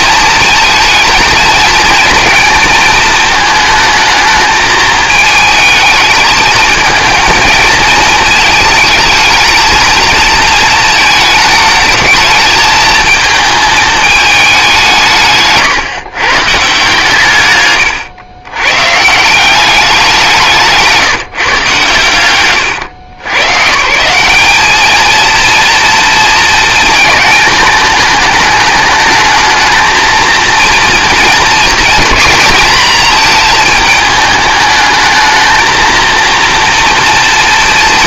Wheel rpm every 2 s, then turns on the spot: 230, 220, 220, 220, 220, 230, 220, 180, 140, 130, 160, 110, 220, 220, 210, 230, 230, 210, 230.
none